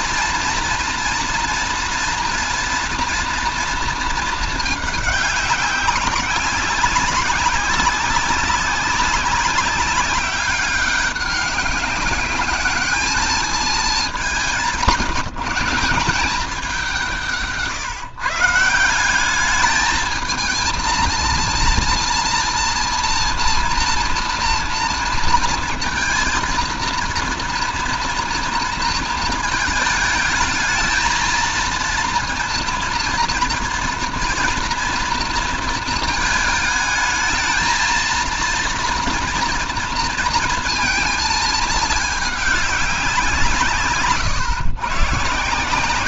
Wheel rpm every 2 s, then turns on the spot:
230, 230, 220, 190, 190, 200, 200, 190, 190, 160, 220, 230, 230, 230, 230, 220, 230, 230, 220, 230, 230, 200, 130.
none